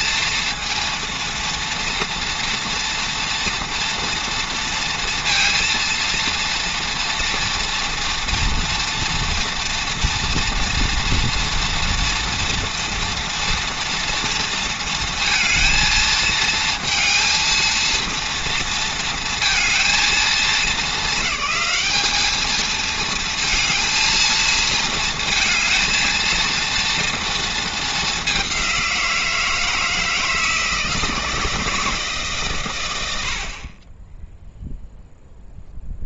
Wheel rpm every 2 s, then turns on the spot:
230, 230, 230, 240, 230, 230, 230, 230, 230, 230, 200, 230, 230, 230, 170, 160, 90, 0.
none